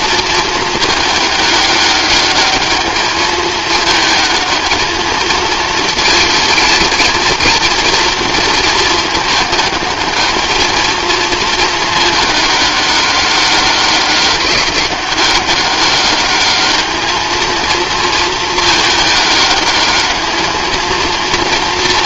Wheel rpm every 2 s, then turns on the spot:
220, 210, 220, 230, 220, 220, 210, 200, 210, 220, 220.
none